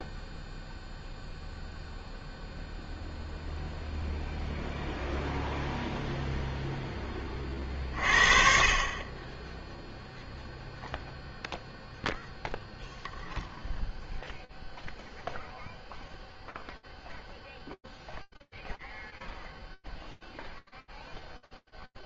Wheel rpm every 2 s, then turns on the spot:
0, 0, 0, 0, 40, 0, 0, 0, 0, 0, 0.
none